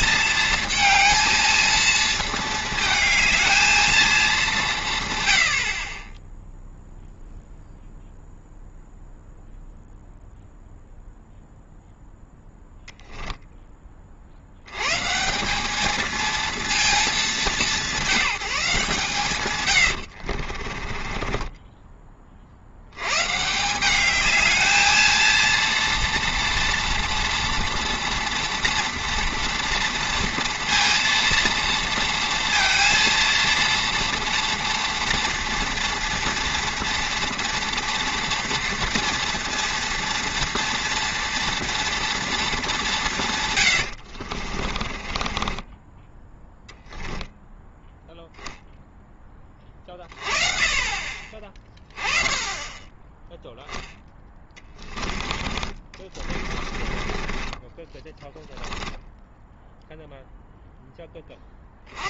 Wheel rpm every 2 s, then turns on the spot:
220, 220, 190, 0, 0, 0, 0, 80, 230, 170, 40, 60, 220, 230, 230, 230, 230, 230, 230, 230, 230, 220, 40, 10, 0, 30, 20, 10, 30, 10, 0.
20-22 44-46 56-60